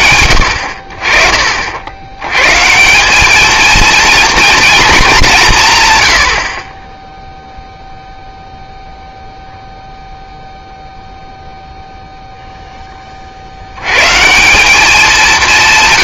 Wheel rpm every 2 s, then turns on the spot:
50, 190, 210, 10, 0, 0, 100, 200.
none